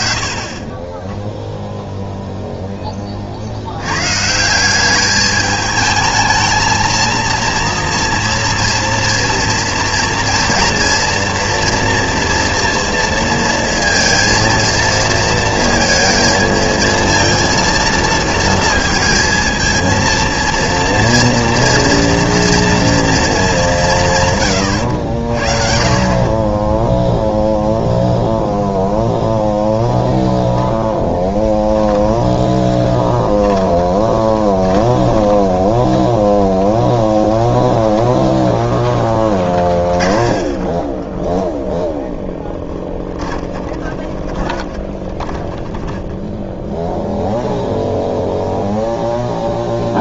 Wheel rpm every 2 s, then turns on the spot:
10, 50, 210, 230, 230, 230, 230, 230, 230, 230, 230, 190, 60, 0, 0, 10, 20, 20, 0, 0, 20, 10, 30, 0, 0.
32-36 40-46